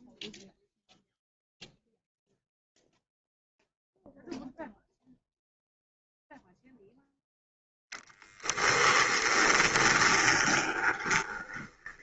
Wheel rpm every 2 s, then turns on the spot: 0, 0, 0, 0, 10, 30.
8-12